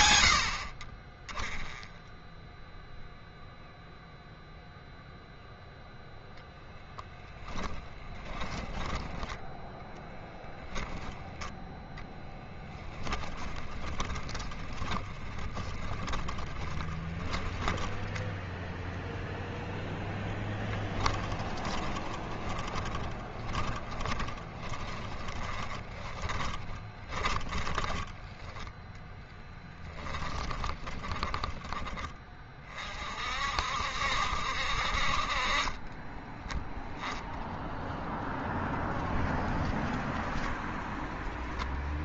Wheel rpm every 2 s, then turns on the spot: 40, 0, 0, 10, 30, 20, 10, 10, 20, 10, 20, 20, 30, 20, 10, 20, 40, 50, 0, 0, 0.
8-18 20-28 30-32